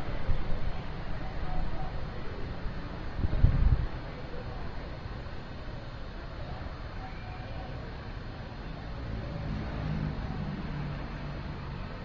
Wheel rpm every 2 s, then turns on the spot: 0, 0, 0, 0, 0, 0.
none